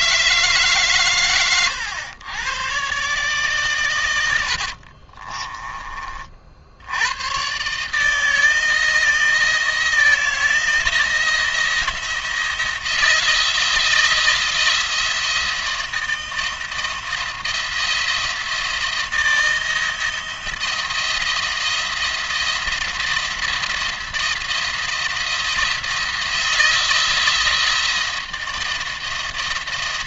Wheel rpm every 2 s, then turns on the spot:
150, 120, 70, 80, 160, 170, 170, 170, 170, 170, 170, 170, 170, 160, 170.
4-6